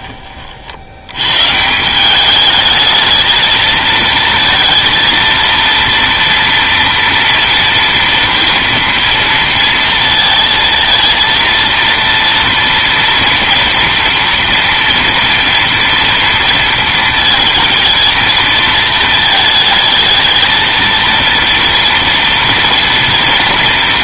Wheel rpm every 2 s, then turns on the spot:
50, 210, 230, 230, 230, 220, 230, 230, 230, 230, 230, 240.
none